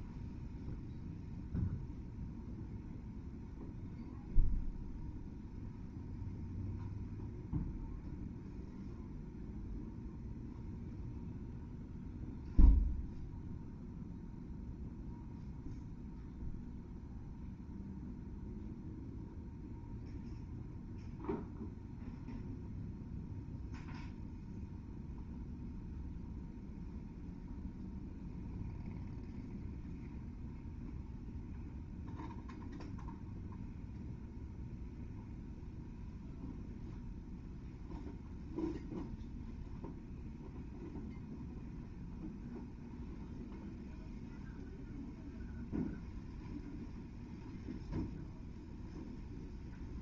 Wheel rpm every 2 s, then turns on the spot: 0, 0, 0, 0, 0, 0, 0, 0, 0, 0, 0, 0, 0, 0, 0, 0, 0, 0, 0, 0, 0, 0, 0, 0, 0.
none